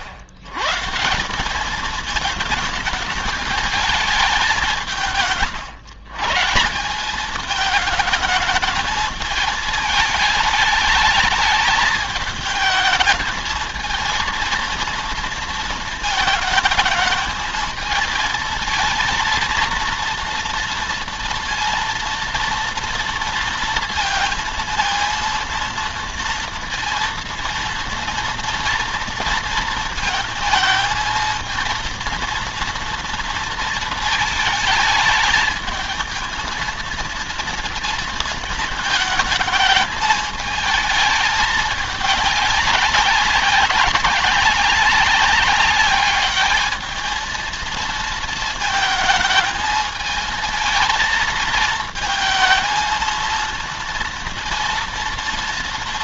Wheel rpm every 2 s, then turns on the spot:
140, 220, 180, 170, 220, 220, 220, 230, 220, 230, 230, 230, 230, 230, 230, 220, 230, 220, 230, 220, 220, 200, 200, 220, 220, 220, 230, 230.
none